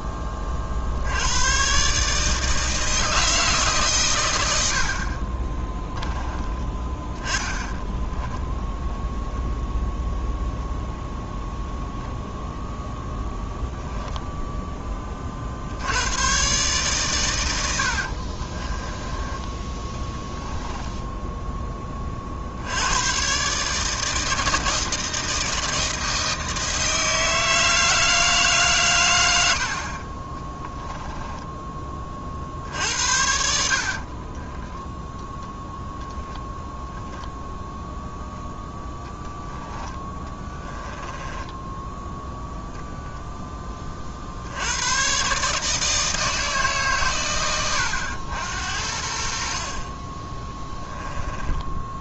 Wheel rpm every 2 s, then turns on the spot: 50, 160, 70, 10, 0, 0, 0, 10, 130, 30, 10, 80, 160, 160, 140, 20, 60, 10, 0, 10, 20, 0, 90, 150, 70, 10.
18-22 30-32 34-36 40-42 50-52